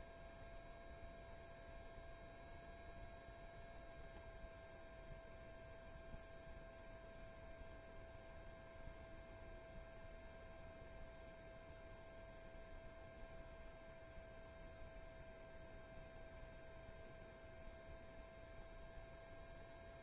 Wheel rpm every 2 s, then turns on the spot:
0, 0, 0, 0, 0, 0, 0, 0, 0, 0.
none